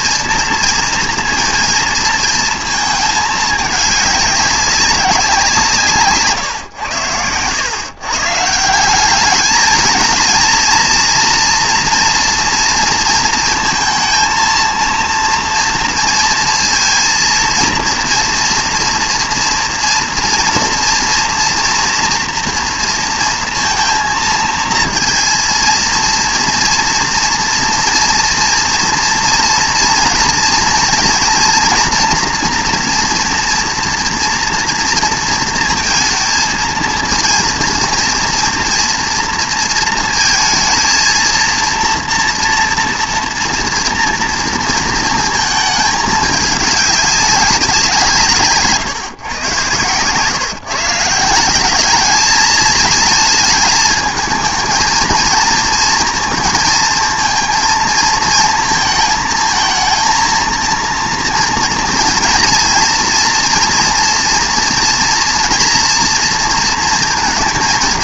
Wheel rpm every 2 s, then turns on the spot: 230, 220, 200, 110, 180, 230, 230, 230, 230, 230, 230, 230, 230, 230, 230, 230, 240, 230, 230, 230, 230, 230, 230, 210, 140, 160, 220, 220, 230, 220, 230, 230, 230, 230.
none